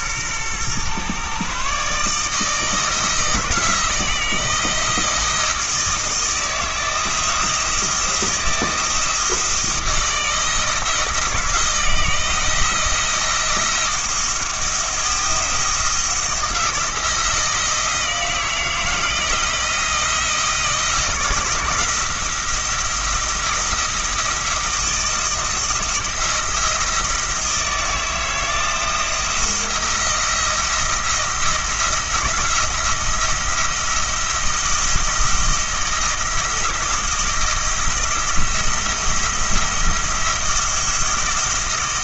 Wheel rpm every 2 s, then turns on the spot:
120, 160, 160, 160, 170, 160, 160, 170, 170, 170, 170, 170, 170, 170, 160, 170, 170, 170, 160, 170, 170.
none